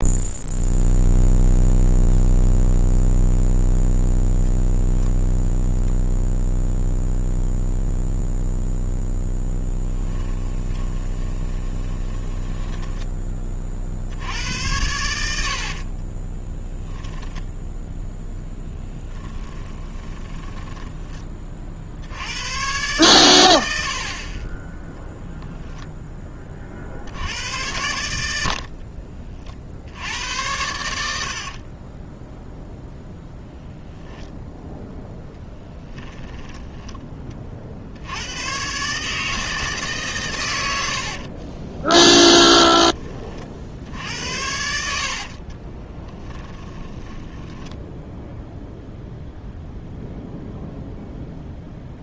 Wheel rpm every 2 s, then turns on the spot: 0, 0, 0, 0, 0, 20, 10, 90, 10, 10, 10, 100, 20, 40, 70, 90, 0, 0, 10, 120, 100, 10, 70, 10, 0, 0.
10-14 16-22 28-30 36-38 46-48